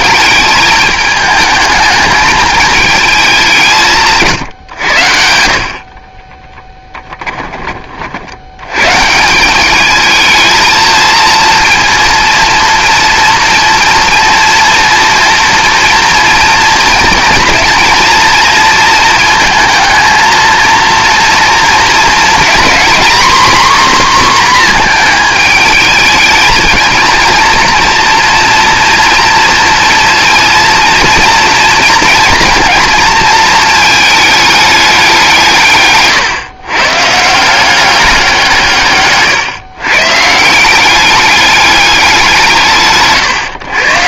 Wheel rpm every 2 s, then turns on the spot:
220, 220, 120, 10, 110, 230, 240, 230, 230, 220, 230, 250, 230, 220, 230, 230, 230, 210, 130, 160, 180, 160.
6-8